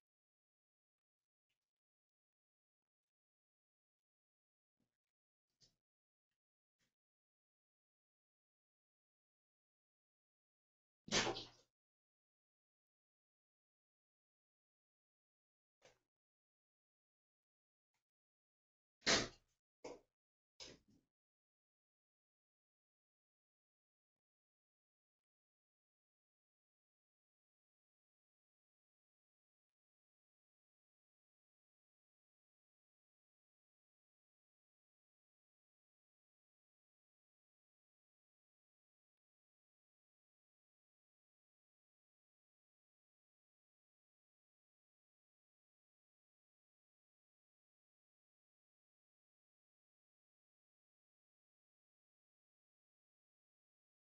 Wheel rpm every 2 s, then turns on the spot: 0, 0, 0, 0, 0, 0, 0, 0, 0, 0, 0, 0, 0, 0, 0, 0, 0, 0, 0, 0, 0, 0, 0, 0, 0, 0, 0.
none